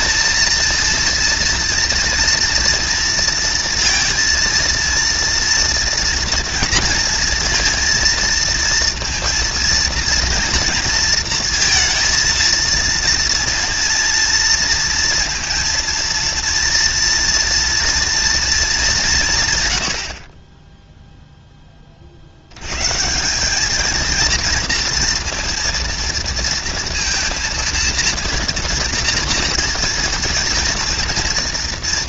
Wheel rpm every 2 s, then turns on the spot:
230, 230, 240, 230, 230, 230, 230, 230, 240, 80, 20, 200, 230, 230, 230, 230.
none